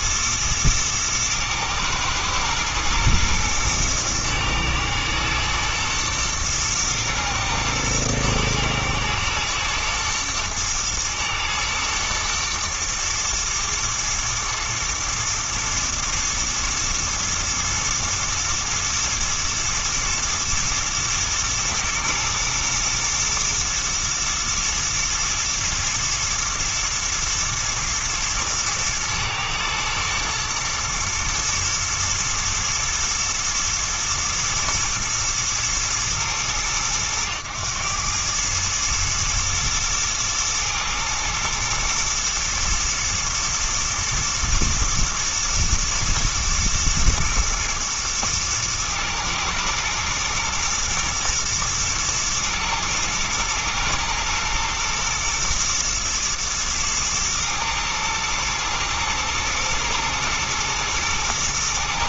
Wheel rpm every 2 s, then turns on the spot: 110, 110, 120, 110, 110, 110, 120, 110, 110, 110, 110, 110, 120, 120, 110, 110, 120, 120, 110, 110, 110, 110, 110, 110, 110, 110, 110, 120, 110, 110, 110.
none